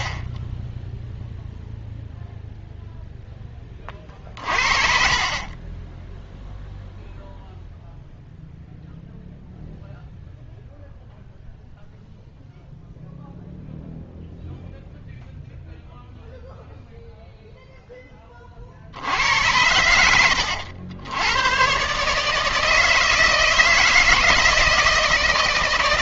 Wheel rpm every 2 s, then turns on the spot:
40, 0, 40, 0, 0, 0, 0, 0, 0, 30, 80, 160, 160.
4-6